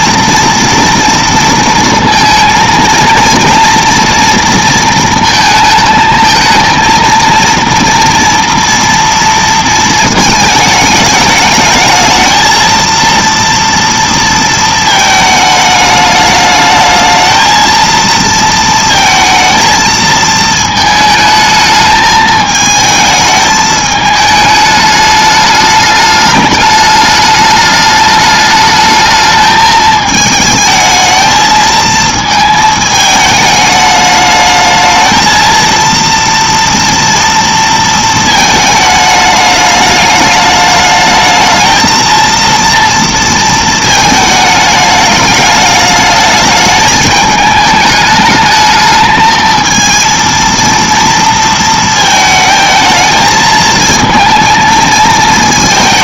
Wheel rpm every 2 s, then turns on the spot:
240, 230, 230, 230, 230, 210, 230, 220, 210, 230, 220, 220, 210, 210, 210, 220, 220, 220, 230, 220, 210, 230, 220, 210, 220, 230, 220, 230.
none